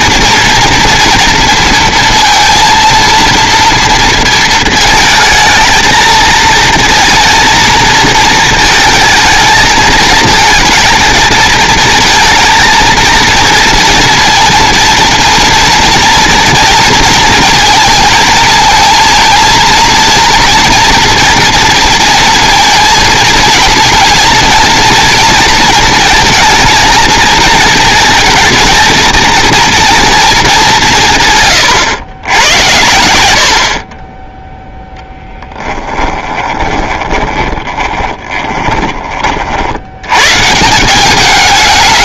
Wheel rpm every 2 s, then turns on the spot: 230, 230, 230, 230, 220, 220, 220, 230, 230, 220, 240, 230, 230, 220, 220, 190, 100, 0, 20, 20, 170.
36-38